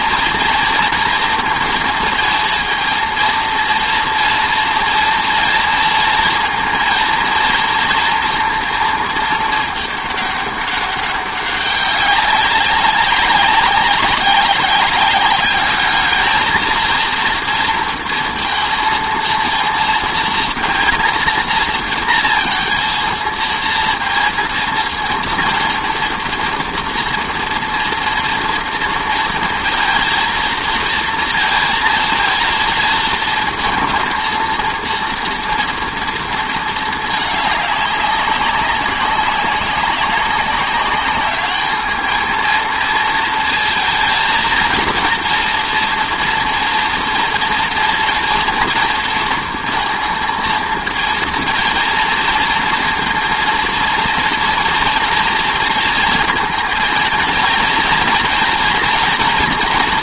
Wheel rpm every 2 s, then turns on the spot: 230, 230, 230, 230, 230, 200, 190, 190, 220, 230, 230, 230, 230, 230, 230, 230, 230, 230, 220, 200, 200, 230, 230, 230, 240, 230, 230, 230, 230, 230.
none